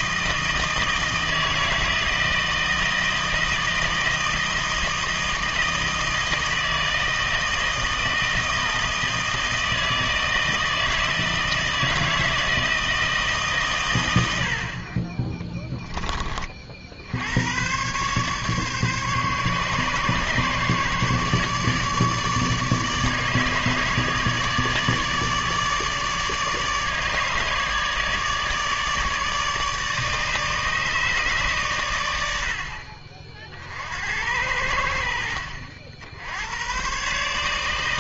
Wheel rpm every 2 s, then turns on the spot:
160, 160, 160, 160, 160, 160, 160, 60, 50, 140, 140, 150, 150, 150, 150, 150, 60, 80, 100.
none